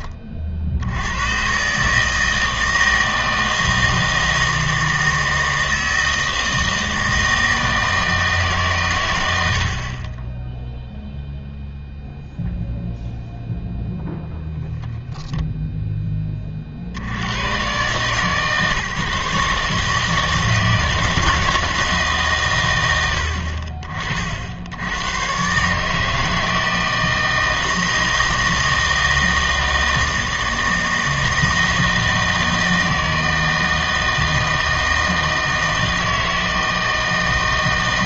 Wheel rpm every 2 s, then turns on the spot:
60, 160, 160, 160, 140, 0, 0, 20, 50, 150, 160, 120, 70, 160, 160, 160, 160, 160, 160.
none